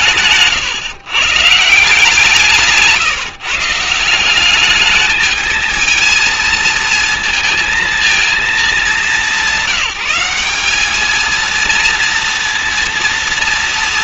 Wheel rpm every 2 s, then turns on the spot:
130, 160, 200, 230, 210, 200, 230.
none